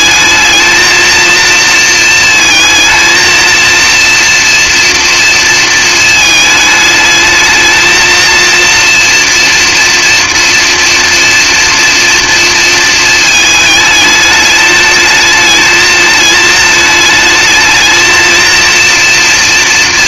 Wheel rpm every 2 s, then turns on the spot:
220, 220, 240, 220, 230, 230, 230, 210, 220, 230.
none